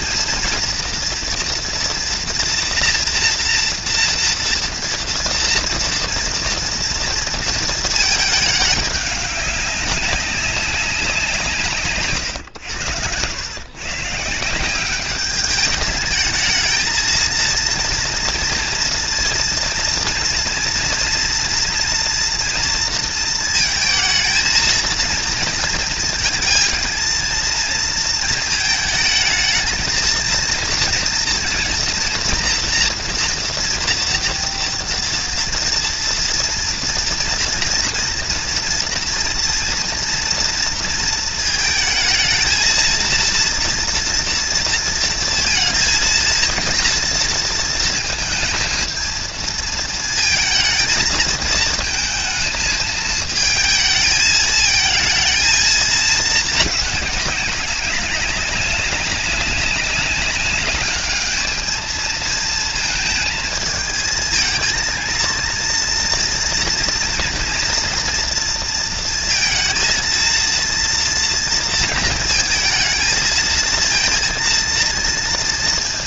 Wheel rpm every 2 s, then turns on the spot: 230, 230, 230, 230, 220, 200, 120, 160, 220, 230, 230, 230, 230, 230, 230, 230, 240, 230, 240, 240, 230, 230, 230, 230, 220, 230, 220, 220, 220, 190, 200, 220, 220, 230, 230, 230, 220, 230.
none